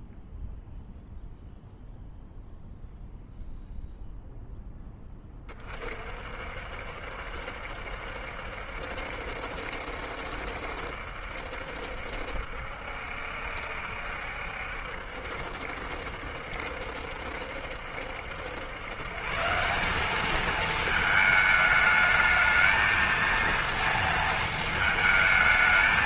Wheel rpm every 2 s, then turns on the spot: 0, 0, 0, 60, 70, 70, 70, 70, 70, 120, 220, 220, 220.
none